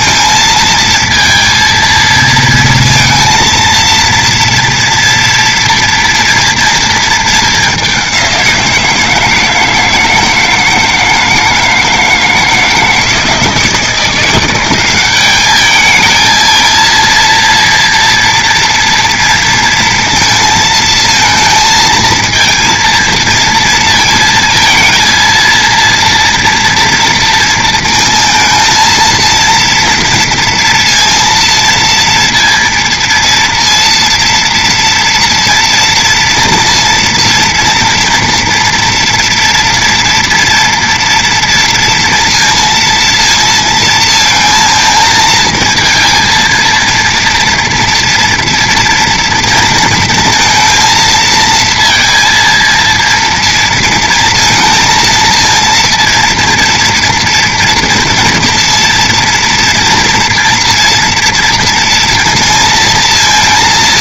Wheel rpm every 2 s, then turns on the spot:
230, 230, 230, 230, 170, 160, 160, 180, 230, 230, 230, 230, 230, 230, 230, 230, 230, 230, 230, 230, 230, 230, 220, 230, 240, 230, 230, 230, 230, 230, 230, 230.
none